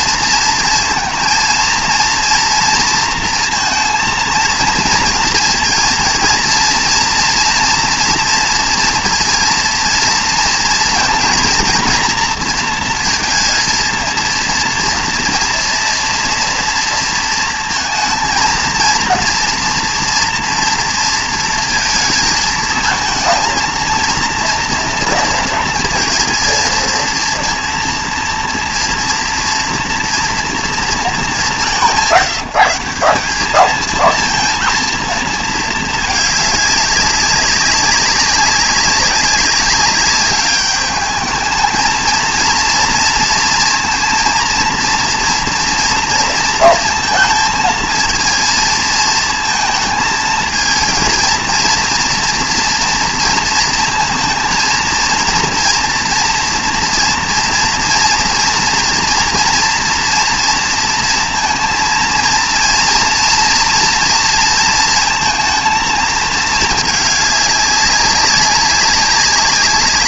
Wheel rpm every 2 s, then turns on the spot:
230, 230, 230, 230, 230, 230, 230, 230, 230, 230, 230, 220, 230, 230, 230, 230, 180, 230, 200, 190, 210, 230, 230, 230, 230, 230, 230, 230, 240, 230, 230, 230, 230, 220, 200.
none